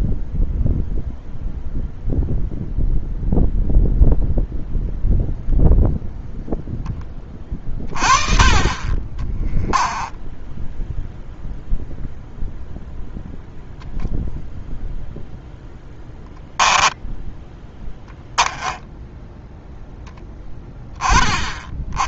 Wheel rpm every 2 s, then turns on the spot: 0, 0, 0, 10, 30, 0, 0, 0, 0, 10, 10.
18-20